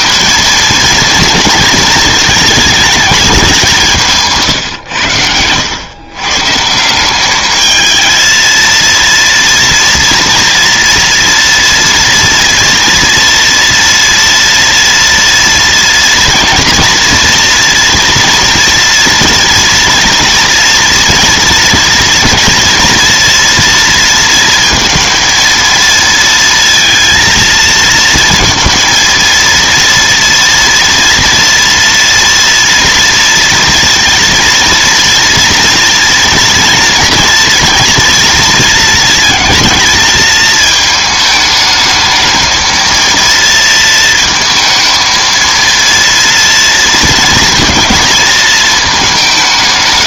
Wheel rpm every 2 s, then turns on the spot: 220, 220, 130, 150, 230, 230, 230, 230, 230, 230, 230, 230, 230, 230, 230, 230, 230, 230, 240, 230, 220, 230, 220, 230, 220.
none